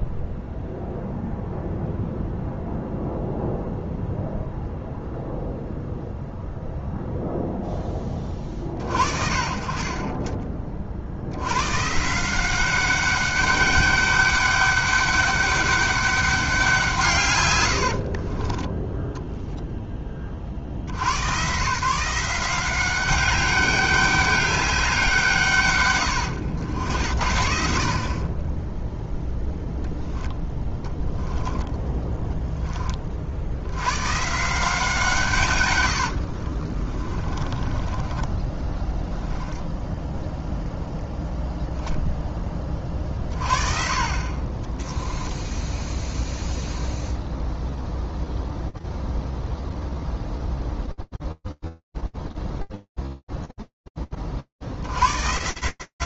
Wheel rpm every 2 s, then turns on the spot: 0, 0, 0, 0, 10, 30, 130, 200, 200, 90, 40, 170, 200, 110, 50, 0, 10, 120, 90, 40, 0, 10, 30, 0, 0, 0, 90, 100.
18-20 32-34 36-40